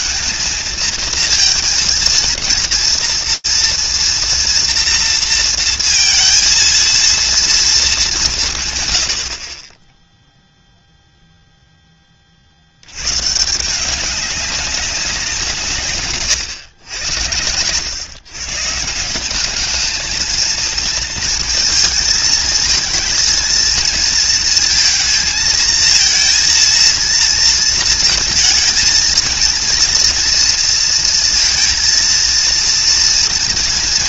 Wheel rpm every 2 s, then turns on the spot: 230, 230, 230, 230, 170, 0, 90, 190, 100, 170, 230, 230, 220, 230, 220, 230, 230.
none